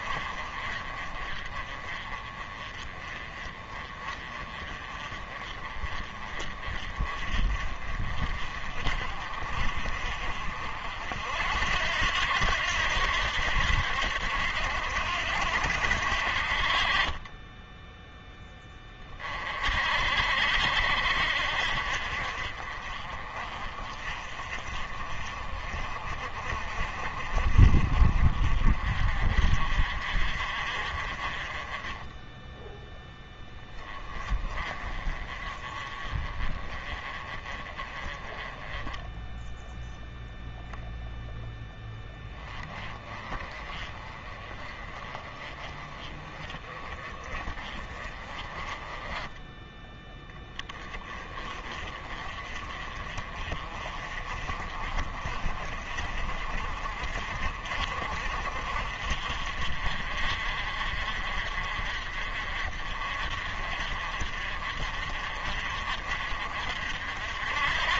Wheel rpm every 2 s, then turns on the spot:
40, 30, 30, 30, 40, 50, 80, 70, 40, 20, 70, 40, 40, 40, 40, 40, 10, 30, 30, 10, 0, 20, 30, 30, 20, 20, 30, 30, 40, 50, 50, 50, 50, 60.
none